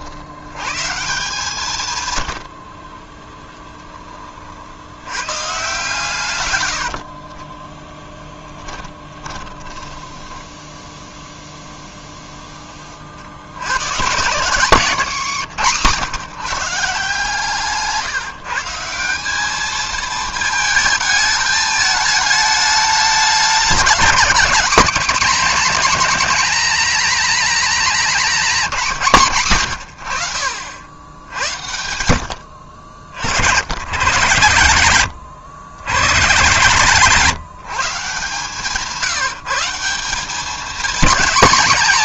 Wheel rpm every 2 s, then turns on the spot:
90, 80, 40, 120, 20, 10, 10, 160, 140, 150, 220, 210, 220, 240, 210, 80, 60, 120, 150, 160, 200.
8-12